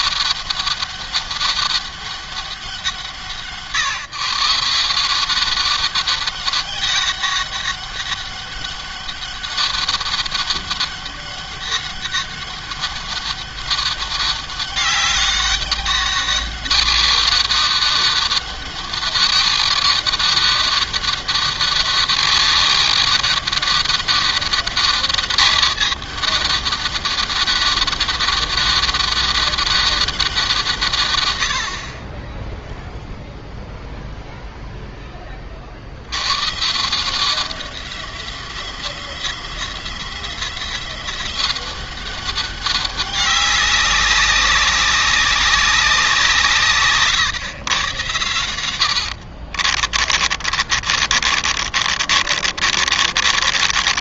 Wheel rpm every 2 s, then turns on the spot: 200, 180, 180, 200, 200, 200, 200, 200, 200, 200, 200, 200, 200, 200, 200, 130, 0, 10, 160, 180, 180, 200, 200, 130, 80, 40, 40.
48-54